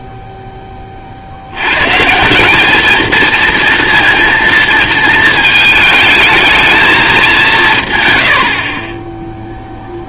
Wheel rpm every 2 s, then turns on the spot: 20, 210, 230, 220, 90.
none